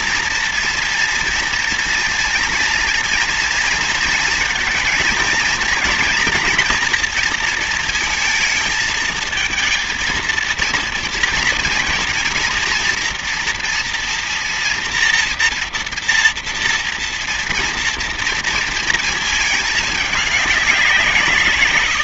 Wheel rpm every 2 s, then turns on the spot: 230, 240, 230, 230, 220, 230, 230, 230, 230, 230, 190.
none